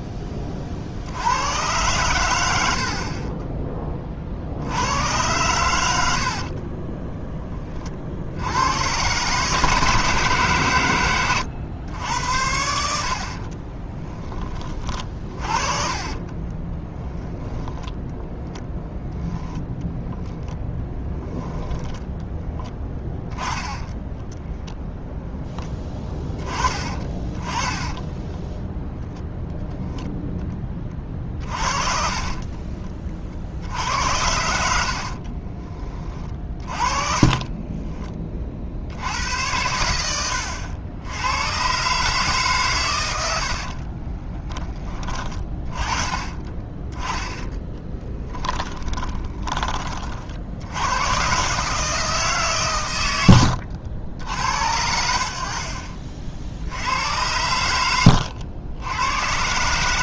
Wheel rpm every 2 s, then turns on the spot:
50, 60, 90, 30, 100, 130, 70, 30, 20, 10, 10, 10, 10, 30, 0, 20, 40, 60, 30, 60, 80, 120, 20, 20, 10, 90, 130, 70, 80, 90.
6-8 14-18 34-38 46-50